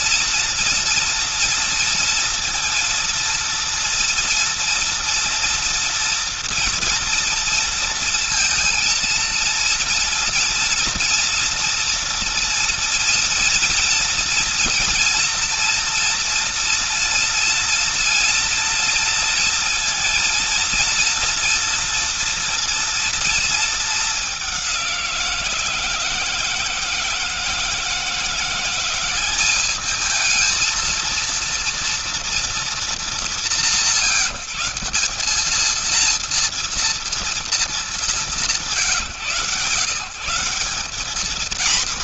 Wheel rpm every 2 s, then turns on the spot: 240, 230, 230, 230, 230, 240, 230, 230, 230, 230, 230, 240, 190, 160, 180, 220, 210, 160, 230, 130, 190.
none